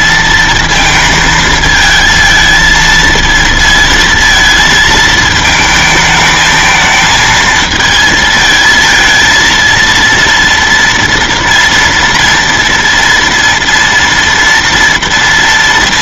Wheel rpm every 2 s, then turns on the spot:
220, 220, 220, 220, 220, 230, 230, 230.
none